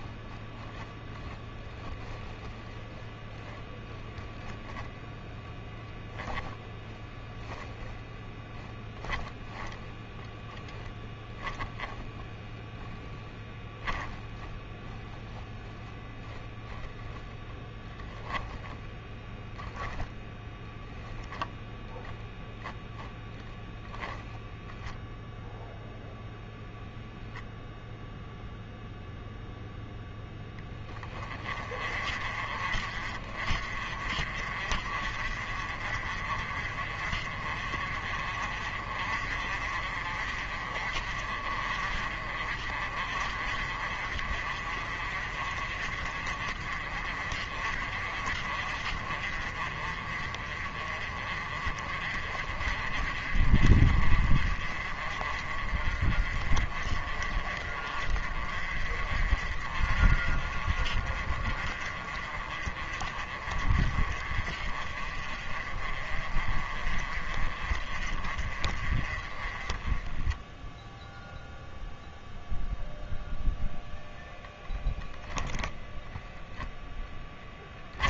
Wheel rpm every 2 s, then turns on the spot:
0, 0, 10, 10, 0, 10, 10, 10, 10, 10, 0, 0, 0, 0, 0, 20, 40, 40, 40, 50, 40, 50, 40, 40, 40, 40, 40, 40, 40, 40, 40, 40, 40, 40, 30, 0, 0, 0, 0.
4-6 12-14